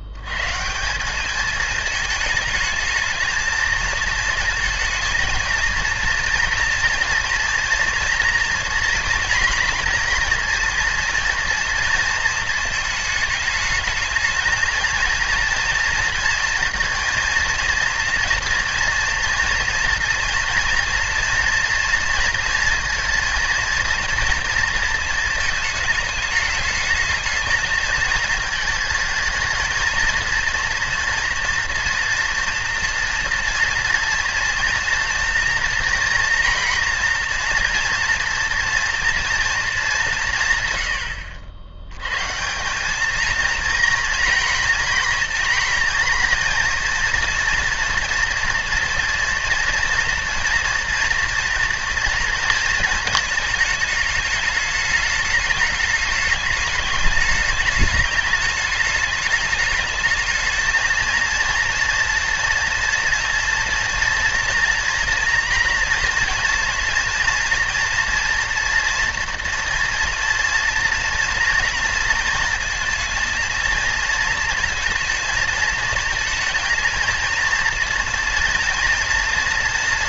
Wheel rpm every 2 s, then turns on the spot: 80, 220, 230, 230, 230, 230, 220, 220, 230, 240, 230, 230, 230, 210, 220, 230, 240, 230, 230, 230, 120, 180, 230, 230, 230, 230, 230, 210, 210, 210, 220, 230, 230, 230, 240, 230, 220, 230, 220, 240.
none